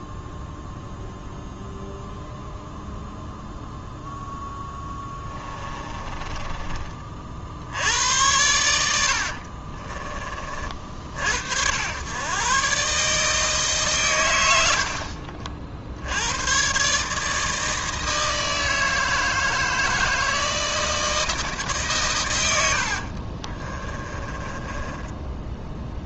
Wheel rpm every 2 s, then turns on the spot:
0, 0, 10, 20, 90, 40, 130, 80, 120, 160, 160, 90, 20.
4-8 22-26